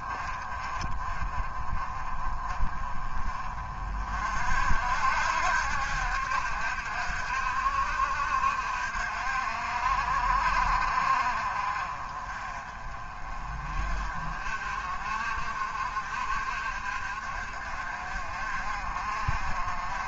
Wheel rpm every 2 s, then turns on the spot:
30, 30, 60, 60, 60, 50, 30, 40, 50, 50.
none